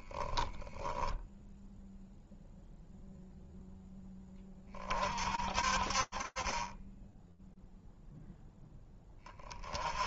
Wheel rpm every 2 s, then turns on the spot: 0, 0, 40, 0, 30.
none